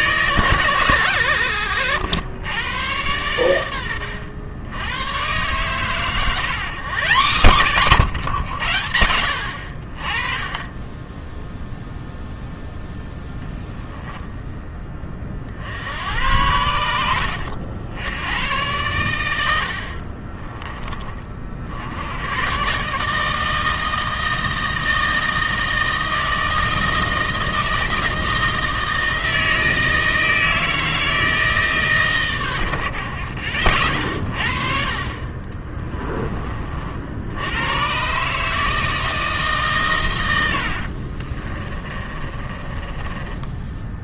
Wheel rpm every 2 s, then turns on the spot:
100, 100, 100, 160, 100, 10, 0, 20, 90, 110, 20, 140, 160, 160, 160, 160, 110, 40, 50, 160, 60, 20.
40-44